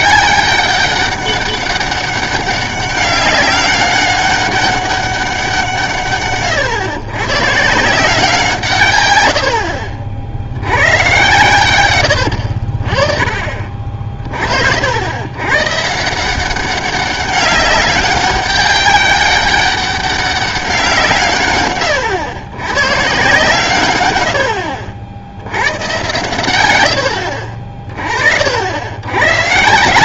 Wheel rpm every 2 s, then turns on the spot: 200, 200, 200, 130, 150, 90, 70, 60, 190, 200, 190, 110, 60, 120, 60.
none